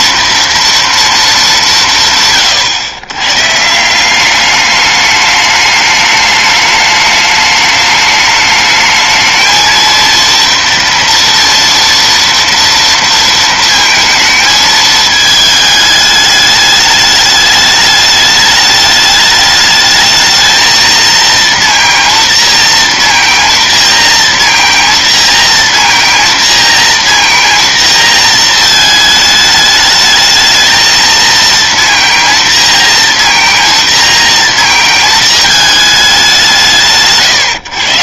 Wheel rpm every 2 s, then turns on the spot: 210, 130, 210, 210, 220, 230, 230, 220, 210, 210, 230, 230, 230, 230, 220, 230, 230, 220, 140.
none